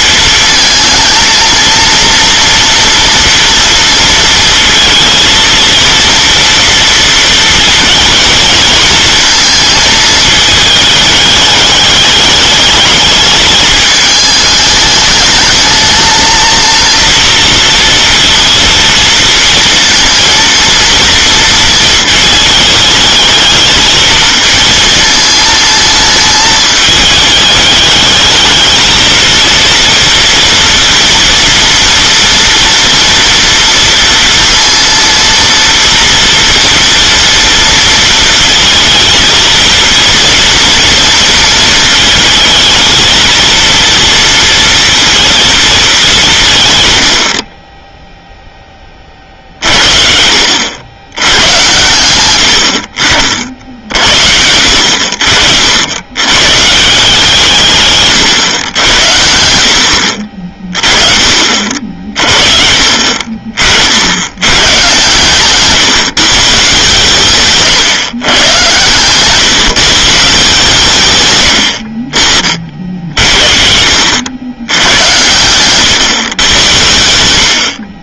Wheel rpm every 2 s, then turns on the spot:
220, 230, 230, 230, 220, 220, 210, 210, 230, 230, 230, 220, 220, 210, 220, 230, 240, 230, 230, 230, 230, 220, 230, 150, 10, 80, 70, 80, 140, 110, 40, 50, 100, 140, 130, 160, 60, 90, 100.
none